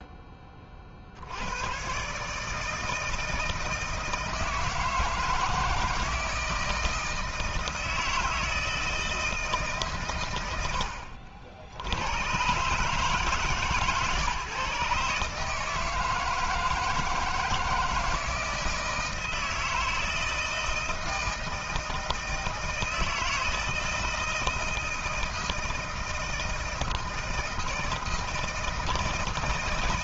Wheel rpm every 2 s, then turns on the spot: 20, 150, 160, 160, 160, 110, 130, 140, 160, 160, 160, 160, 160, 160, 160.
none